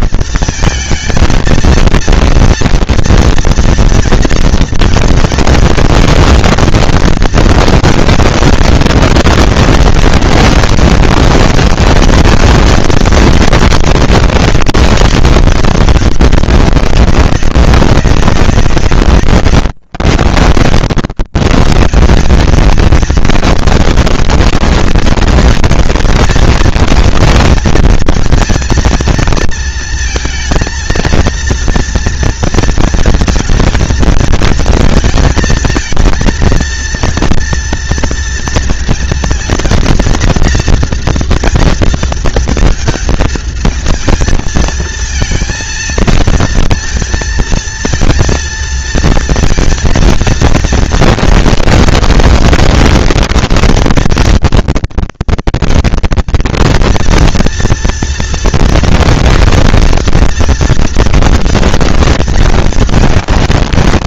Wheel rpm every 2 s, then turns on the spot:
230, 240, 230, 230, 230, 230, 230, 220, 200, 170, 100, 210, 230, 230, 230, 230, 230, 220, 230, 230, 230, 230, 230, 230, 230, 230, 230, 230, 230, 230, 230, 230.
none